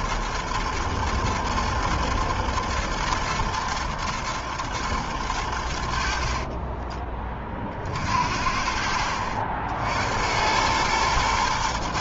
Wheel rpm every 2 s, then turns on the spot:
120, 110, 120, 50, 50, 90.
6-8